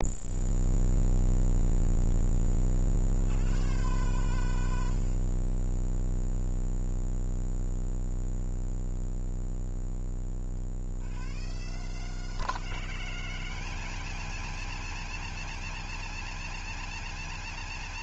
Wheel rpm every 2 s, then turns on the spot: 0, 90, 50, 20, 20, 100, 180, 230, 230.
4-10